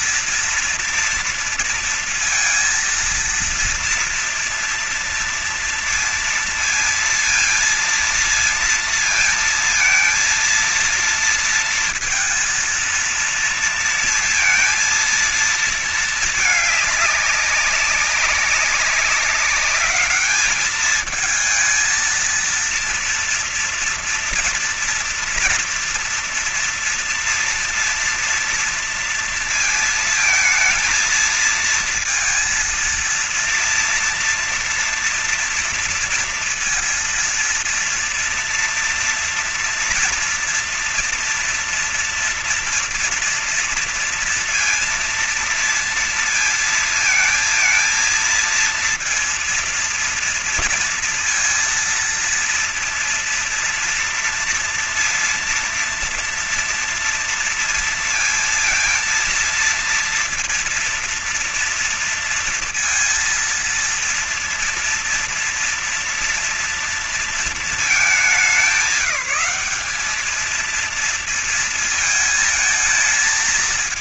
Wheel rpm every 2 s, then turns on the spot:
230, 230, 240, 230, 230, 230, 230, 230, 220, 200, 210, 230, 240, 230, 230, 230, 230, 230, 230, 230, 230, 230, 230, 230, 230, 230, 230, 230, 230, 230, 230, 230, 230, 230, 200, 210, 220.
none